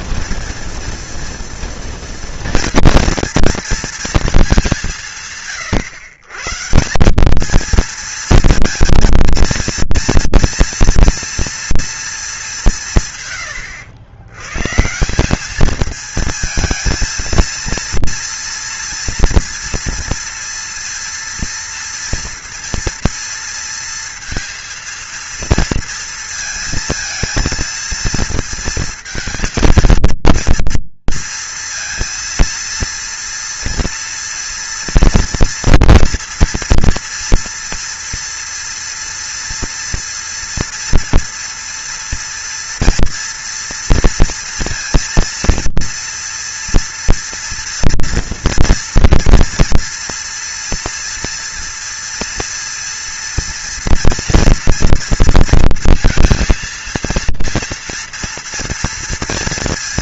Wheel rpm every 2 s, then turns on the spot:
230, 240, 200, 150, 220, 230, 200, 120, 230, 230, 230, 230, 230, 230, 230, 230, 230, 230, 230, 230, 230, 230, 230, 230, 230, 230, 230, 230, 230, 230.
none